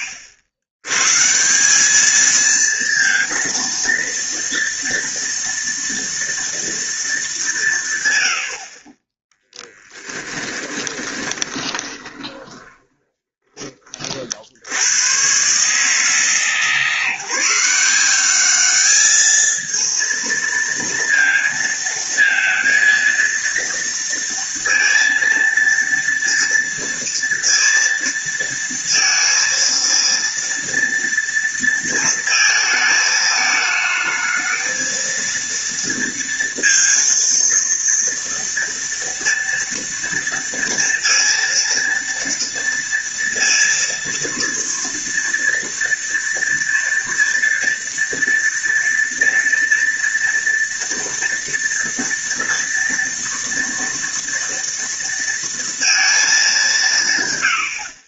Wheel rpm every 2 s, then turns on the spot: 90, 230, 230, 230, 30, 20, 20, 90, 160, 210, 230, 230, 230, 230, 230, 230, 220, 230, 230, 230, 230, 230, 230, 230, 230, 230, 230, 230, 170.
10-14